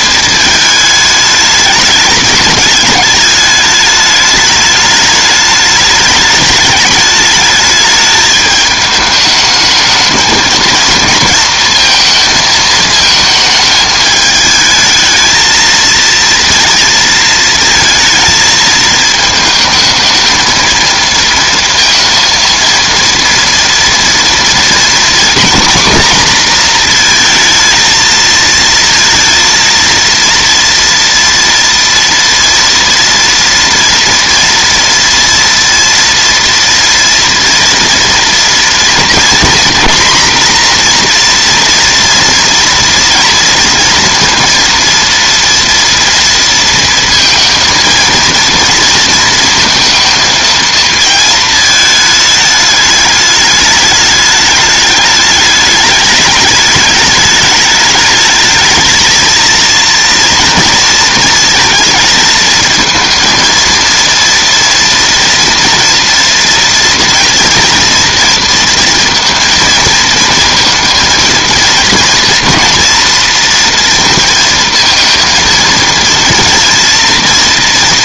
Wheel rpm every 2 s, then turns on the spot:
220, 210, 210, 210, 210, 220, 220, 220, 230, 220, 220, 230, 230, 240, 230, 230, 230, 230, 240, 230, 240, 230, 230, 230, 230, 220, 210, 210, 210, 220, 230, 220, 230, 230, 230, 220, 230, 230, 230.
none